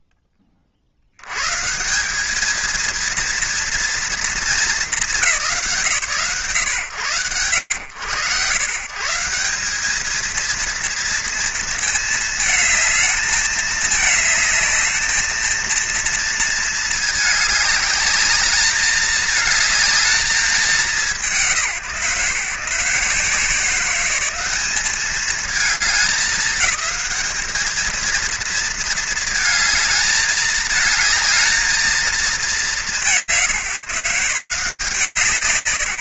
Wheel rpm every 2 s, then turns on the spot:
60, 230, 190, 70, 160, 230, 220, 220, 220, 220, 170, 160, 210, 210, 220, 220, 160, 170.
none